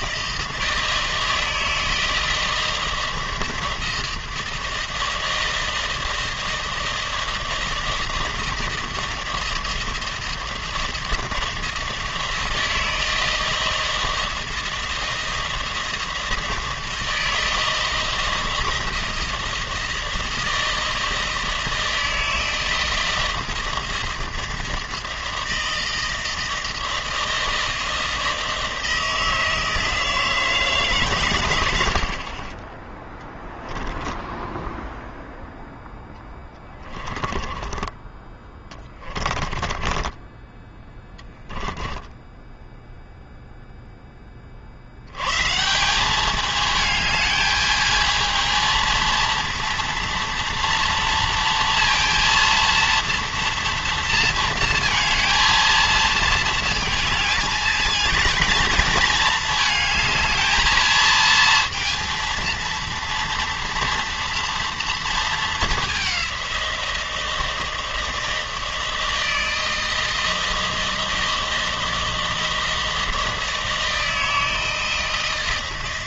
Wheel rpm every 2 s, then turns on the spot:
160, 160, 160, 160, 160, 160, 160, 160, 160, 160, 160, 160, 160, 160, 160, 160, 50, 0, 10, 20, 20, 10, 20, 200, 220, 230, 230, 230, 230, 220, 220, 230, 230, 190, 160, 160, 160, 160.
36-38 40-44